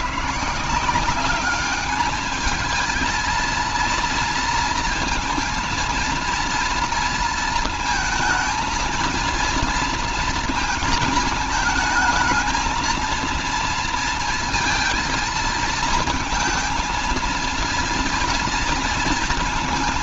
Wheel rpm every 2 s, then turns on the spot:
160, 220, 230, 230, 220, 220, 220, 230, 230, 230.
none